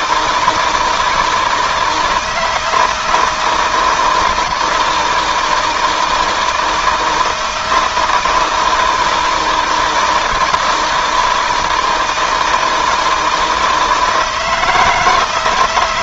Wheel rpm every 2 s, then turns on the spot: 160, 160, 160, 160, 170, 160, 160, 160.
none